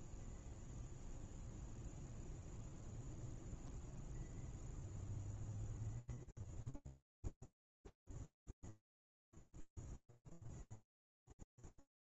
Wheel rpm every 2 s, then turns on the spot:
0, 0, 0, 0, 0, 0.
none